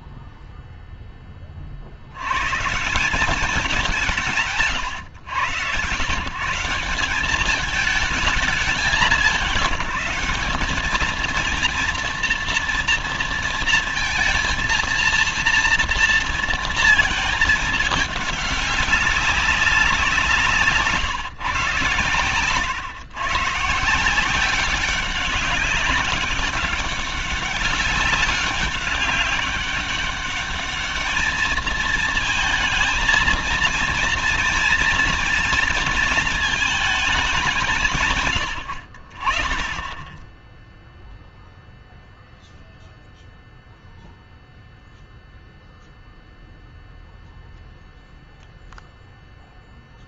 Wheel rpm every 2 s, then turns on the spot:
0, 120, 160, 160, 200, 200, 230, 230, 230, 200, 160, 120, 180, 200, 190, 200, 220, 230, 220, 120, 10, 0, 0, 0, 0.
none